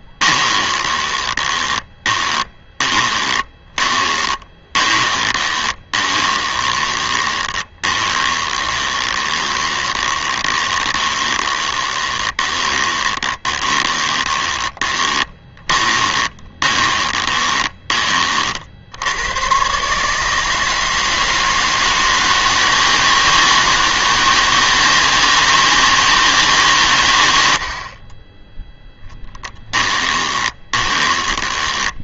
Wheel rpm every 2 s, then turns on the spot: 20, 20, 30, 20, 20, 20, 20, 20, 20, 80, 160, 160, 160, 120, 0, 20.
0-18 30-32